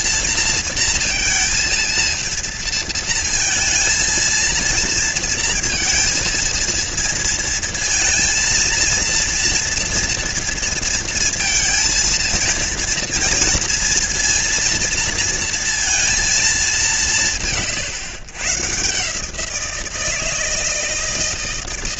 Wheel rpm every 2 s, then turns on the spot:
230, 230, 230, 230, 230, 230, 230, 230, 200, 130, 160.
none